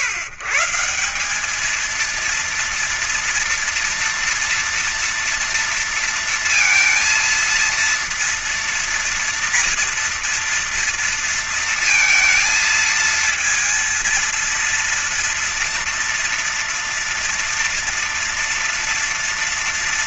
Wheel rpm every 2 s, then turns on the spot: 150, 230, 230, 230, 230, 230, 220, 230, 230, 230.
none